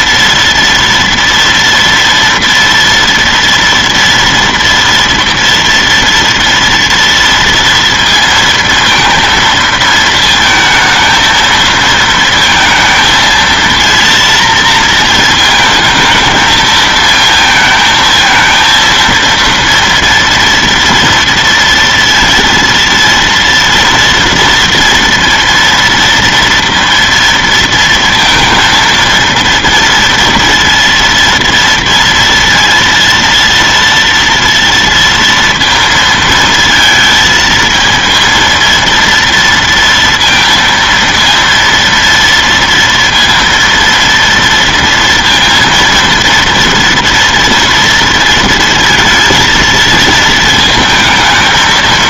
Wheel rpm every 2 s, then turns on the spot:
230, 230, 230, 230, 230, 220, 230, 230, 220, 230, 240, 230, 230, 230, 230, 230, 230, 230, 220, 230, 230, 230, 230, 230, 230, 220.
none